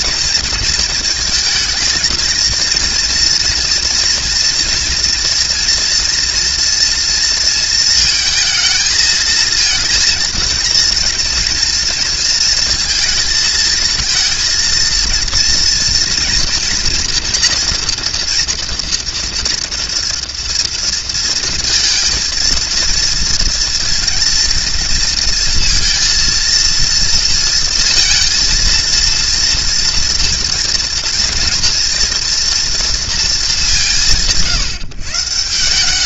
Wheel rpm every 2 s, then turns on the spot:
230, 230, 230, 230, 220, 230, 230, 230, 230, 230, 230, 230, 230, 230, 230, 230, 240, 140.
none